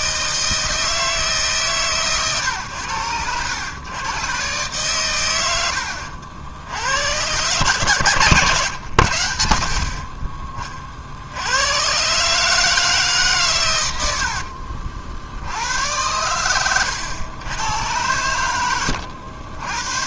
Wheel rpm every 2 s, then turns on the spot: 160, 110, 120, 90, 100, 40, 150, 60, 100, 80.
none